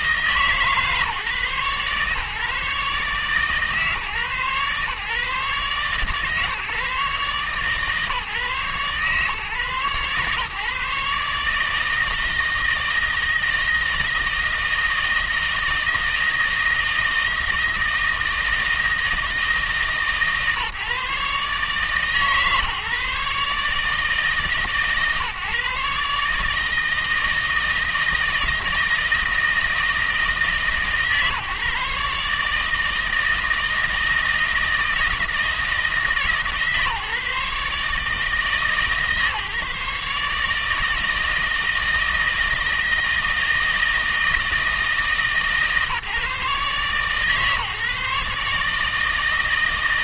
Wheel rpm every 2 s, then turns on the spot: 150, 140, 140, 140, 140, 140, 160, 160, 160, 160, 150, 150, 150, 160, 160, 140, 150, 160, 150, 150, 160, 160, 160, 140, 150.
none